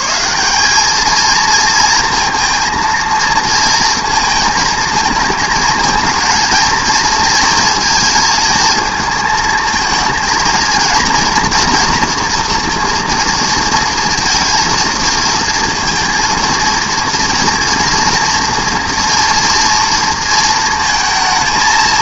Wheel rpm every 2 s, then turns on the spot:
230, 230, 220, 230, 220, 240, 220, 230, 240, 230, 230.
none